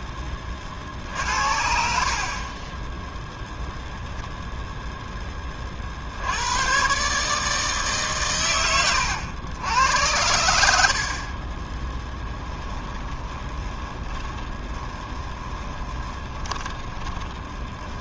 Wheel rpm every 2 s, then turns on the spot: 40, 10, 0, 120, 90, 80, 10, 20, 30.
12-18